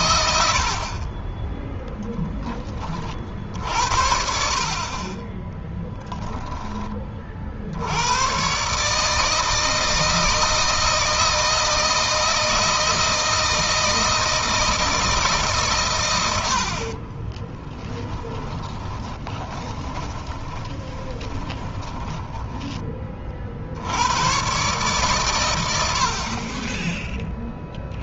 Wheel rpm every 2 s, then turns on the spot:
60, 20, 50, 20, 130, 160, 160, 160, 60, 20, 20, 20, 130, 20.
16-22